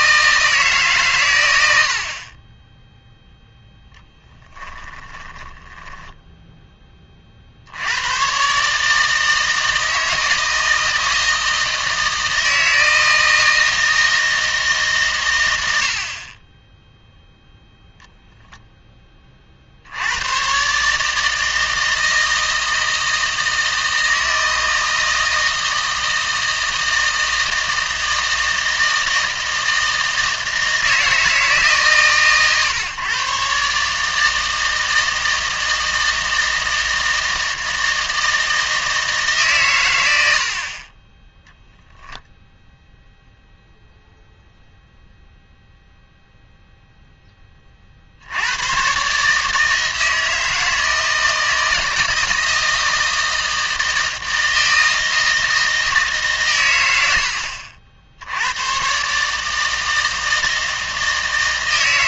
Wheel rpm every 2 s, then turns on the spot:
140, 0, 10, 20, 140, 160, 160, 150, 10, 10, 140, 160, 160, 160, 160, 160, 130, 160, 160, 160, 40, 0, 0, 0, 100, 160, 160, 160, 110, 120, 160.
4-6